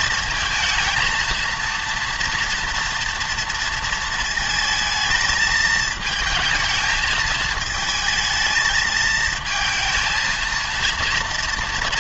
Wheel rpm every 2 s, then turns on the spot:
220, 230, 220, 220, 220, 230.
none